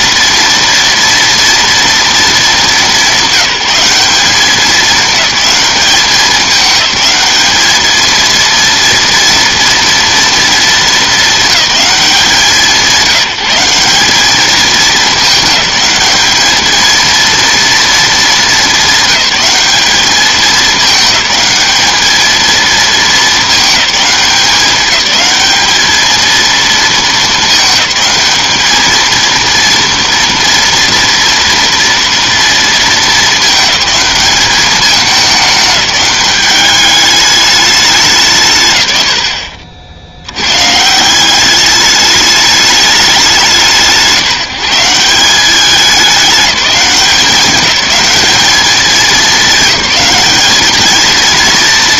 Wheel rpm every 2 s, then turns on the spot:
230, 210, 200, 200, 230, 230, 190, 210, 220, 210, 210, 220, 190, 230, 220, 230, 230, 210, 200, 120, 140, 210, 180, 200, 210, 220.
none